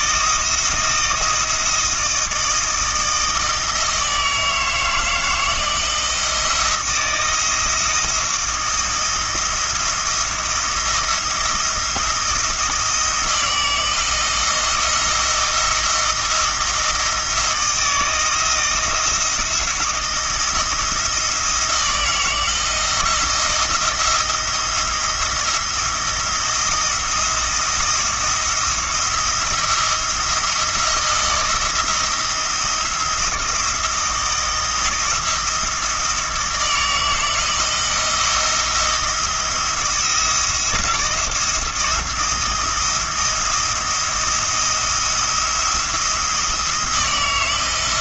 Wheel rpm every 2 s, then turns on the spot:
170, 160, 160, 170, 160, 170, 170, 170, 160, 170, 170, 170, 170, 170, 170, 170, 170, 160, 160, 170, 170, 170, 160, 160.
none